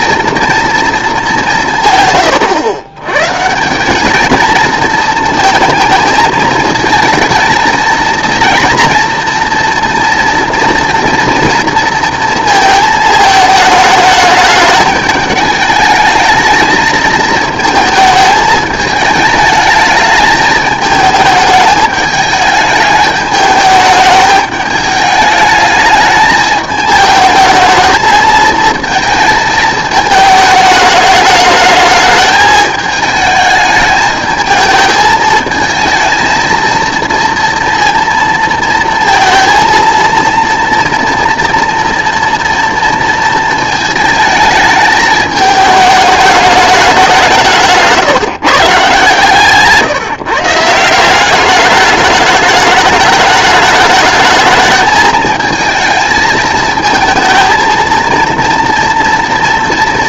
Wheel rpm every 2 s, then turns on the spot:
230, 120, 220, 220, 230, 230, 220, 210, 220, 220, 210, 210, 210, 220, 220, 210, 220, 220, 230, 230, 230, 230, 220, 200, 140, 170, 210, 220, 220, 230.
none